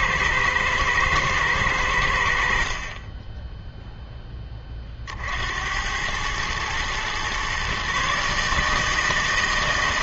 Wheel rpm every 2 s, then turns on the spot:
110, 40, 30, 120, 160.
none